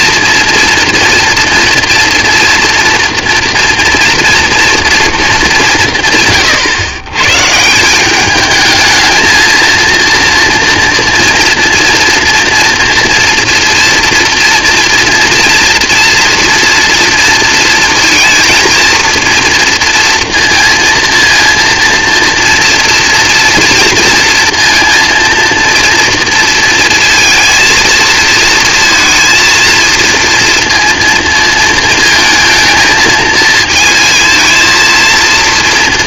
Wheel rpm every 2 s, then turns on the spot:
230, 240, 240, 140, 210, 230, 230, 240, 230, 230, 230, 230, 230, 230, 230, 230, 230, 220.
none